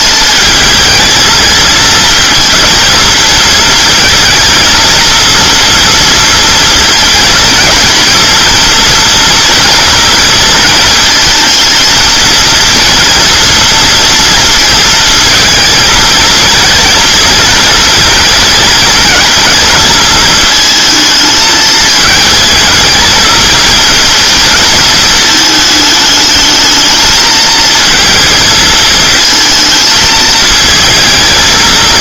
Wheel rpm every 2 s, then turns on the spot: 220, 220, 230, 230, 230, 230, 230, 220, 220, 220, 220, 220, 220, 220, 220, 220.
none